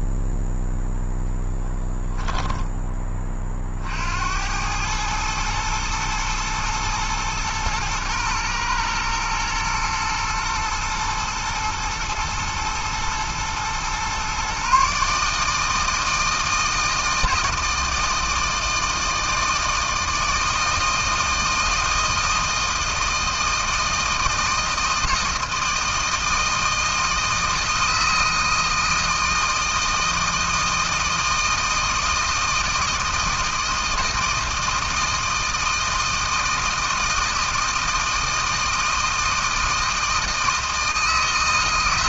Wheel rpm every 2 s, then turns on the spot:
0, 10, 100, 110, 120, 120, 110, 130, 160, 160, 160, 160, 160, 160, 160, 160, 160, 160, 160, 160, 160.
none